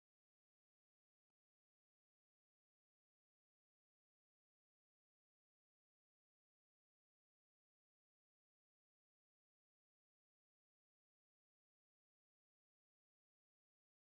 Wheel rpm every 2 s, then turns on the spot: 0, 0, 0, 0, 0, 0, 0.
none